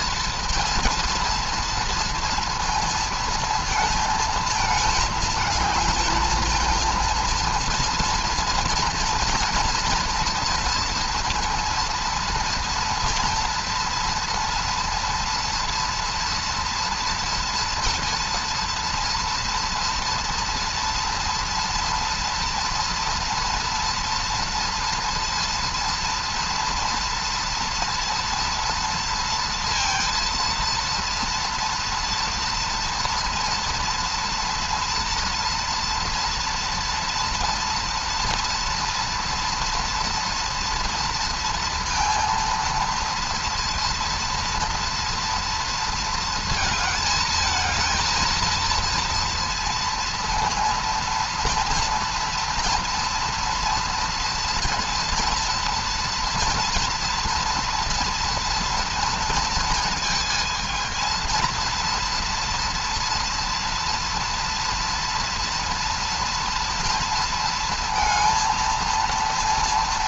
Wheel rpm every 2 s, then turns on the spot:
230, 230, 220, 220, 230, 230, 230, 230, 230, 230, 230, 240, 230, 230, 230, 230, 230, 230, 230, 230, 230, 230, 230, 220, 230, 230, 230, 230, 240, 230, 230, 240, 230, 230, 230.
none